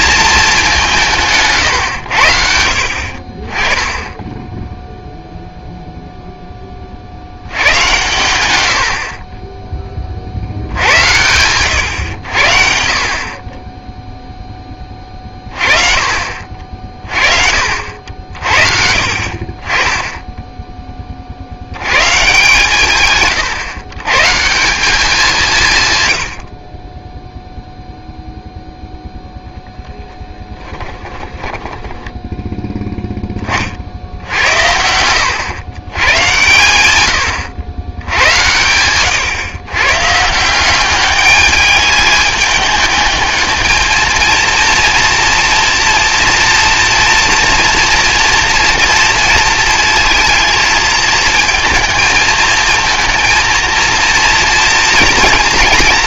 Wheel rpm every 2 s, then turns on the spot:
200, 60, 0, 20, 100, 70, 60, 10, 40, 50, 10, 130, 180, 30, 0, 30, 10, 90, 110, 100, 180, 210, 230, 230, 230, 220, 230, 240.
30-32